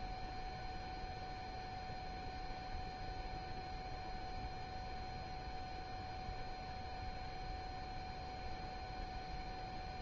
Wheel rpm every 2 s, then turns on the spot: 0, 0, 0, 0, 0.
none